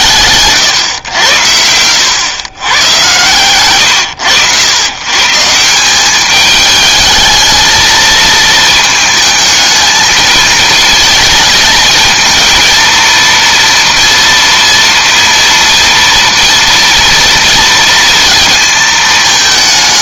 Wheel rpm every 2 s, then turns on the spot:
130, 120, 110, 210, 220, 220, 230, 230, 230, 220.
none